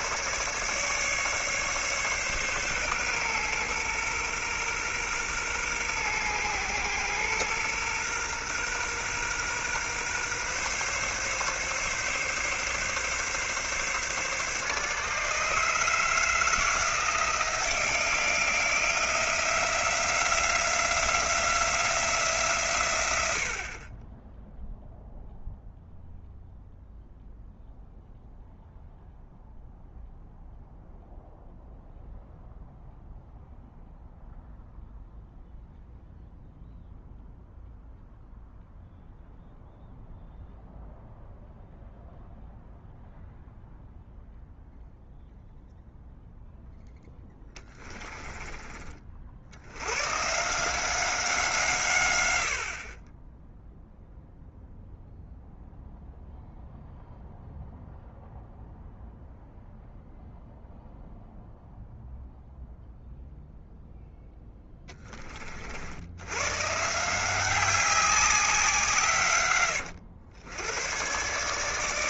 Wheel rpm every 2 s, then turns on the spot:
150, 130, 120, 120, 120, 140, 140, 150, 160, 170, 180, 120, 0, 0, 0, 0, 0, 0, 0, 0, 0, 0, 0, 10, 40, 180, 50, 0, 0, 0, 0, 0, 10, 150, 160, 100.
none